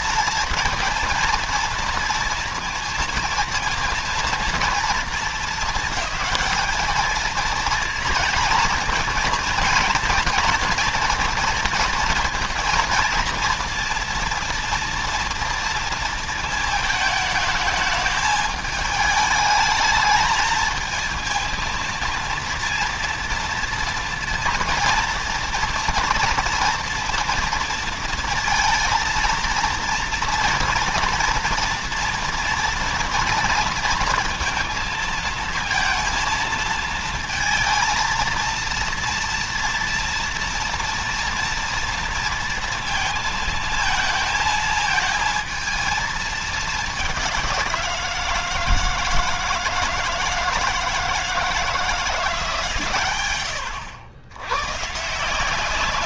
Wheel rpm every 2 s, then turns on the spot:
230, 230, 230, 220, 230, 230, 230, 230, 220, 220, 220, 230, 230, 230, 230, 230, 240, 230, 230, 230, 240, 230, 220, 220, 160, 160, 140, 110.
none